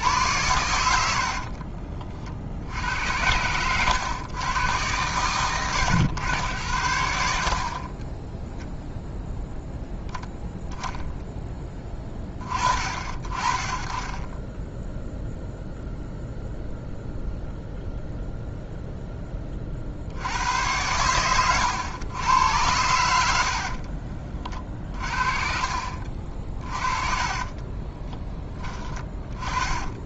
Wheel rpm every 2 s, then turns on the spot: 80, 80, 100, 70, 0, 0, 40, 0, 0, 0, 100, 100, 40, 40, 20.
26-28